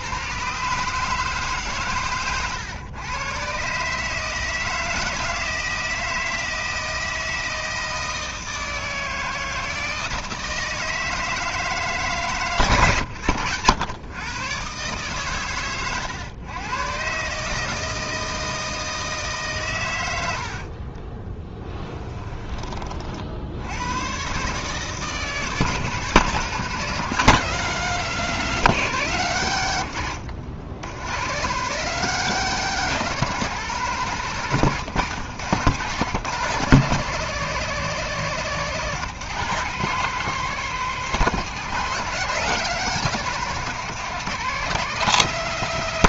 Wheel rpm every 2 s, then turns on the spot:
140, 110, 160, 160, 160, 160, 130, 130, 110, 160, 50, 30, 150, 180, 180, 100, 190, 160, 160, 160, 190, 180, 180.
20-22 34-36